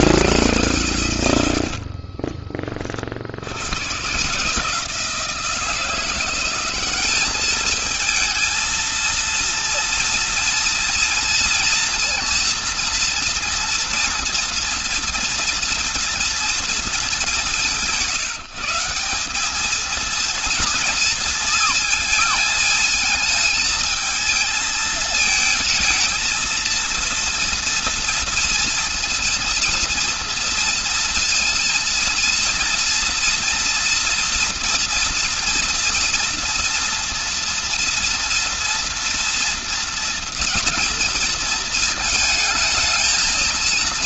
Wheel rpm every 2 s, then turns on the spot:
120, 60, 170, 200, 230, 230, 230, 230, 200, 180, 230, 220, 220, 230, 230, 230, 230, 230, 230, 230, 220, 230.
none